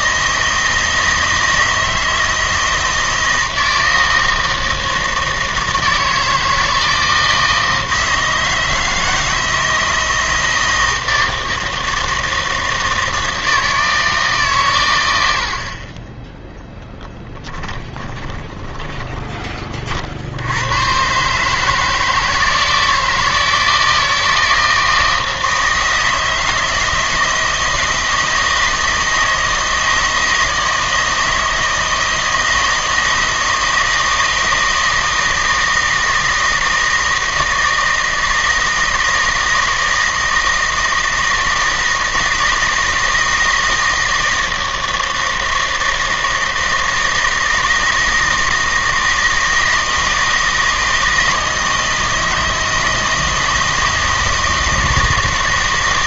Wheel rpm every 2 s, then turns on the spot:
160, 160, 160, 160, 160, 160, 160, 120, 10, 20, 100, 160, 160, 160, 160, 160, 160, 160, 160, 160, 160, 160, 160, 160, 160, 160, 160, 160.
18-20